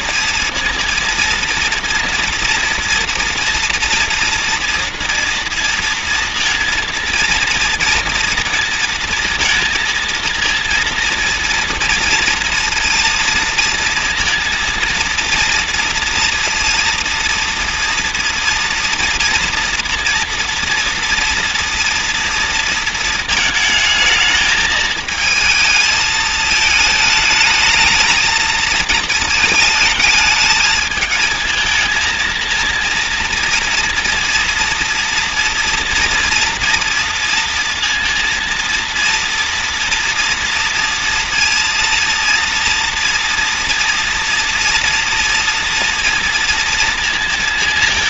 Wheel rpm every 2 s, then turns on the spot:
230, 230, 240, 230, 230, 230, 230, 230, 230, 230, 230, 230, 220, 220, 220, 220, 230, 230, 230, 240, 230, 230, 230, 230.
none